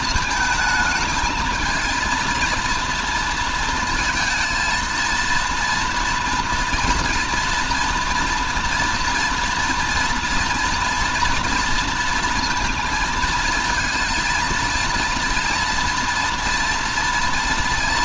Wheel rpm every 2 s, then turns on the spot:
220, 230, 230, 230, 230, 230, 230, 240, 240.
none